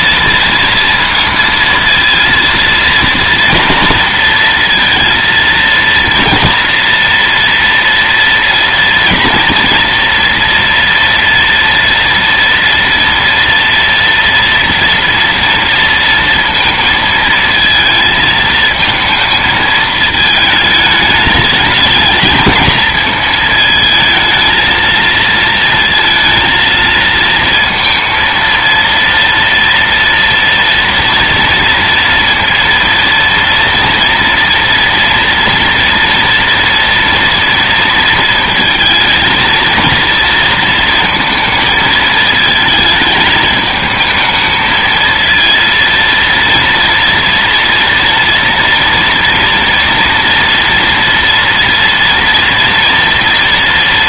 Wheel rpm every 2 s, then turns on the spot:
230, 230, 230, 240, 230, 230, 230, 230, 230, 220, 210, 220, 230, 230, 230, 230, 230, 230, 230, 220, 230, 220, 220, 230, 230, 230, 230.
none